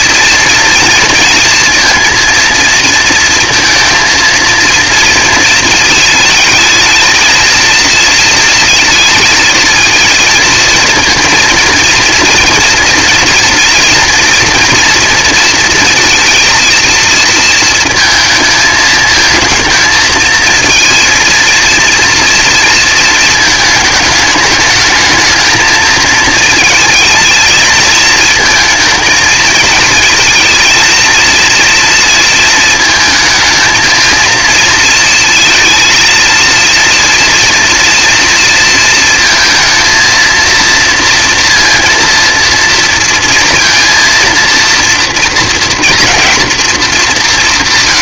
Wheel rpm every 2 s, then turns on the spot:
230, 230, 230, 220, 230, 230, 230, 240, 230, 220, 230, 230, 220, 230, 230, 230, 220, 230, 230, 230, 230, 230, 240, 220.
none